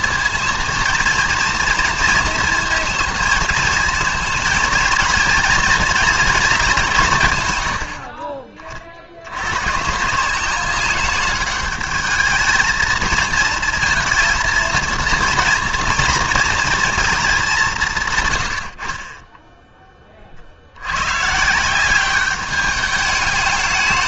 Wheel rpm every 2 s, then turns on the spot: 230, 230, 230, 190, 40, 190, 220, 230, 230, 70, 70, 210.
none